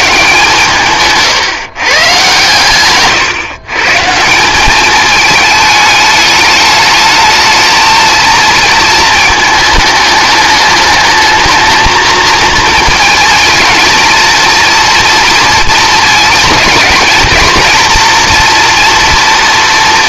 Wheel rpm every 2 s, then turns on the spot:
140, 130, 200, 210, 220, 210, 230, 230, 210, 230.
none